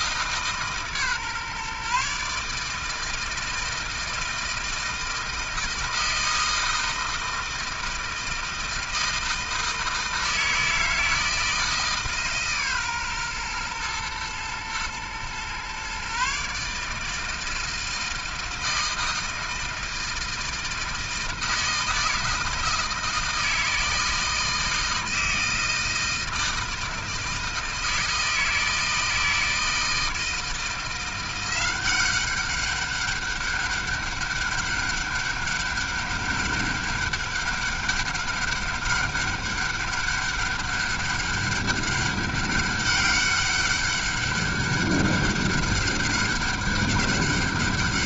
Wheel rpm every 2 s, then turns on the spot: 150, 150, 160, 160, 160, 160, 140, 120, 140, 160, 160, 160, 160, 160, 160, 160, 200, 200, 200, 200, 200, 200, 200, 200.
none